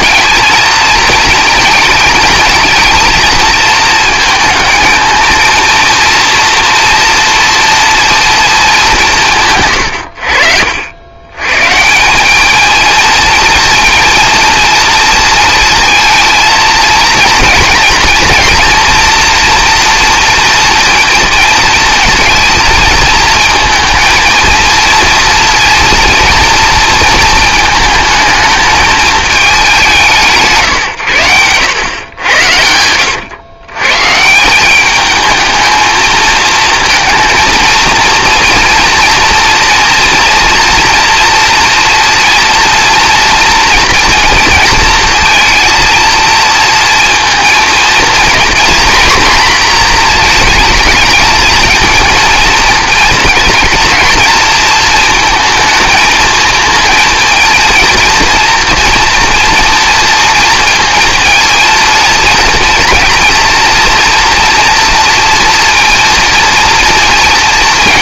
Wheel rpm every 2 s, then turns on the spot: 230, 230, 220, 240, 220, 70, 220, 230, 230, 230, 230, 230, 230, 230, 220, 150, 90, 190, 230, 230, 230, 230, 230, 230, 240, 230, 230, 230, 220, 230, 230, 230, 230, 230.
32-34